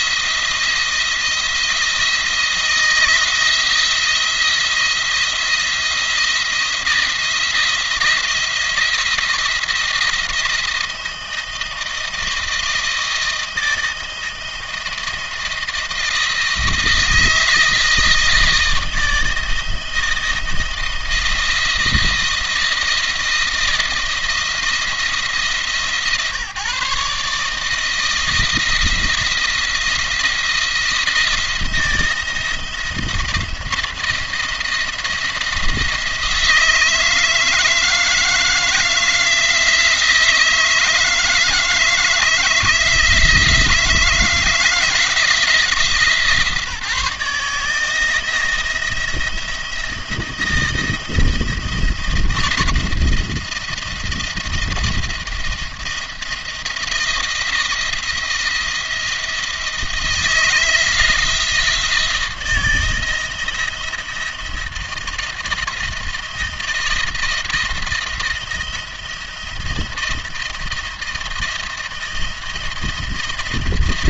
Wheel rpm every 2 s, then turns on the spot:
170, 170, 170, 170, 170, 170, 160, 160, 160, 160, 160, 160, 170, 150, 170, 170, 170, 170, 160, 160, 160, 160, 170, 150, 160, 170, 160, 170, 170, 170, 160, 160, 160, 170, 170, 170, 170.
none